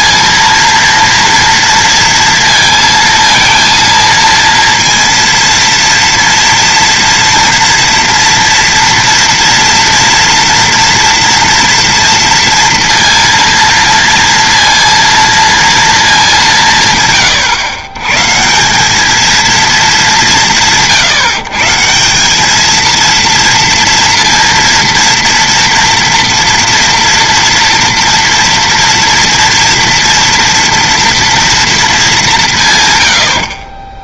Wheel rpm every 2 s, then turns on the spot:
230, 230, 230, 230, 230, 230, 230, 230, 200, 130, 180, 190, 230, 230, 240, 230, 190.
none